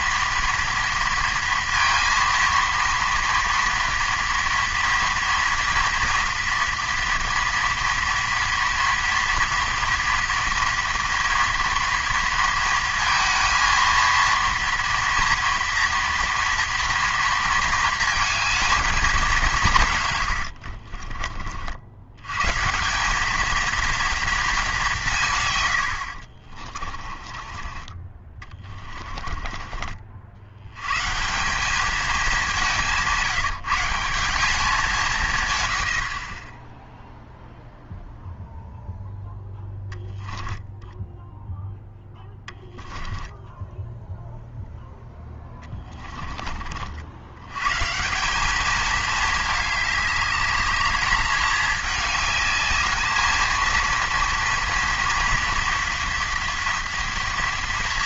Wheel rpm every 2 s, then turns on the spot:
240, 230, 230, 230, 230, 240, 230, 230, 230, 220, 70, 140, 210, 40, 30, 90, 200, 180, 20, 0, 10, 10, 0, 40, 210, 210, 210, 230, 230.
20-22 26-30 40-42